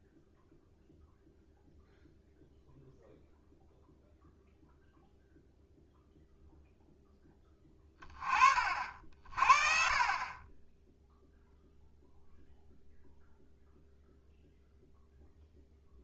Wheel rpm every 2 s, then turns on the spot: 0, 0, 0, 0, 50, 10, 0, 0.
none